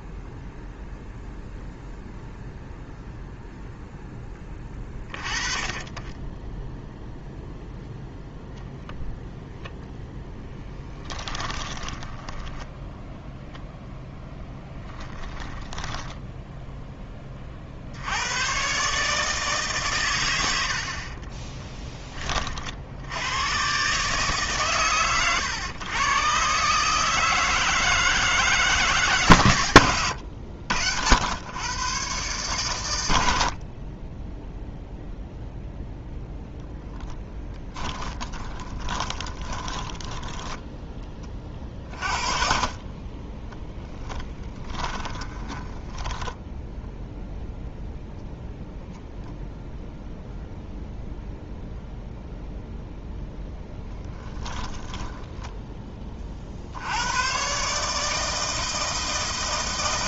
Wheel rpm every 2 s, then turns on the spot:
0, 0, 20, 0, 0, 10, 10, 10, 10, 140, 60, 60, 130, 150, 160, 80, 90, 0, 10, 20, 10, 40, 10, 0, 0, 0, 0, 10, 80, 160.
10-12 14-16 36-40 42-46